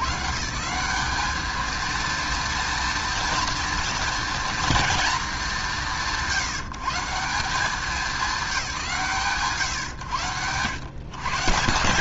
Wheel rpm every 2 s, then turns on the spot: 130, 230, 220, 130, 180, 120.
none